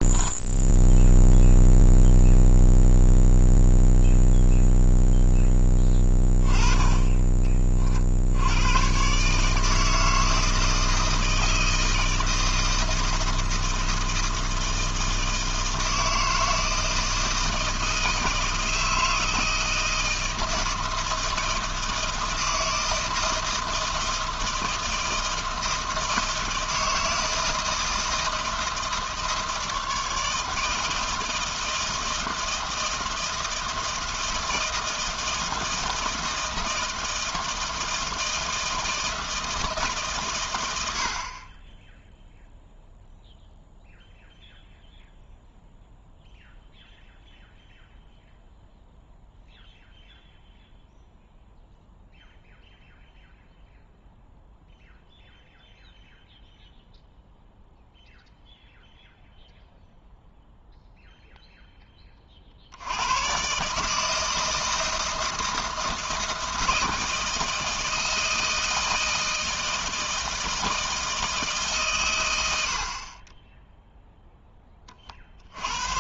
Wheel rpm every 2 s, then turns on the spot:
10, 0, 0, 20, 110, 160, 160, 160, 160, 160, 160, 160, 160, 160, 160, 160, 160, 160, 160, 160, 90, 0, 0, 0, 0, 0, 0, 0, 0, 0, 0, 70, 160, 160, 160, 160, 70, 20.
none